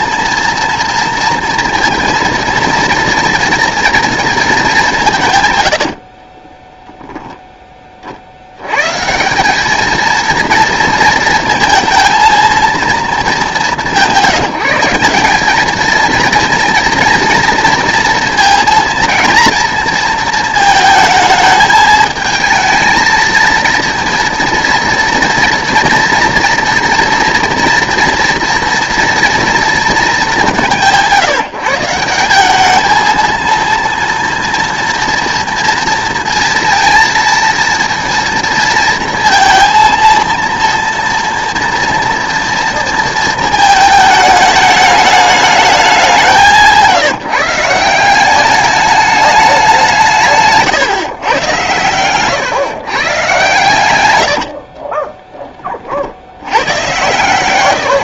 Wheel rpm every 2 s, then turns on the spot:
230, 230, 190, 10, 120, 230, 220, 180, 230, 230, 220, 230, 230, 230, 230, 180, 220, 230, 230, 230, 230, 230, 210, 160, 210, 120, 130, 50, 110.
6-8 54-56